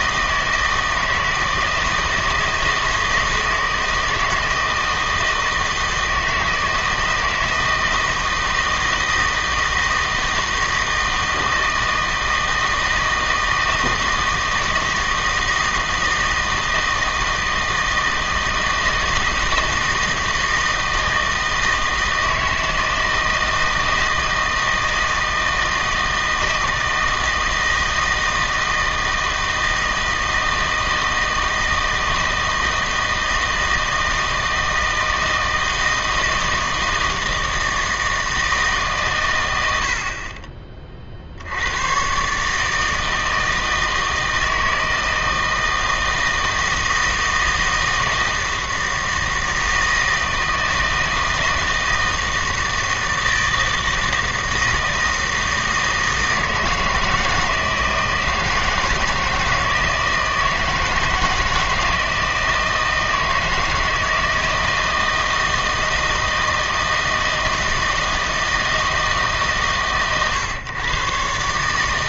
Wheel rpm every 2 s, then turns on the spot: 160, 160, 160, 160, 160, 160, 160, 160, 160, 160, 160, 160, 160, 160, 160, 160, 160, 160, 160, 150, 30, 150, 160, 160, 160, 160, 160, 160, 160, 160, 160, 160, 160, 160, 160, 130.
none